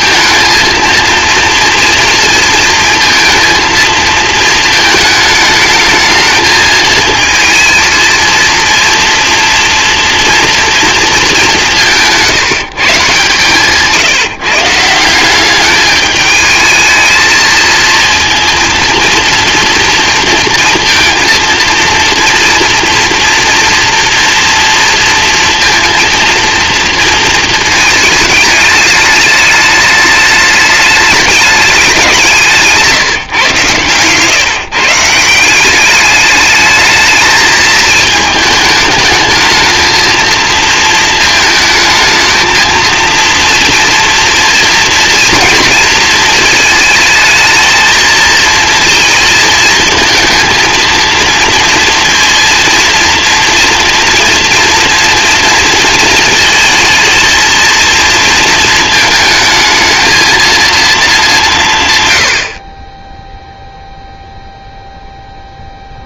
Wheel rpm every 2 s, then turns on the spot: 230, 230, 220, 220, 230, 230, 150, 160, 220, 230, 230, 230, 230, 230, 210, 210, 160, 150, 210, 210, 220, 230, 230, 220, 230, 230, 240, 230, 220, 220, 220, 20, 0.
none